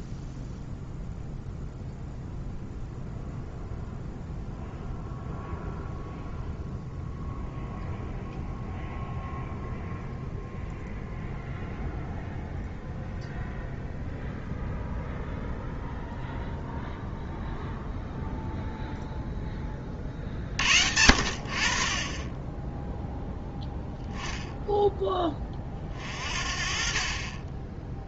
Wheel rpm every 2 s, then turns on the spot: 0, 0, 0, 0, 0, 0, 0, 0, 0, 0, 60, 10, 10, 40.
none